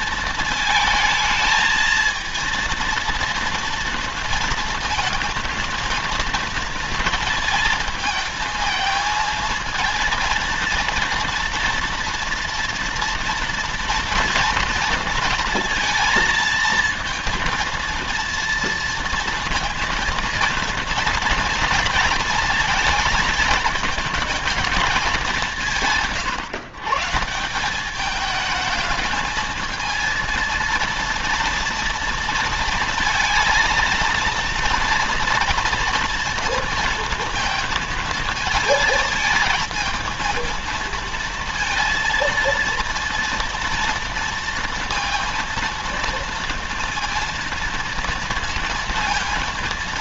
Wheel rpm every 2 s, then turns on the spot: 220, 230, 230, 230, 220, 230, 230, 230, 230, 230, 230, 230, 220, 130, 220, 230, 230, 230, 230, 220, 230, 230, 230, 230, 230.
none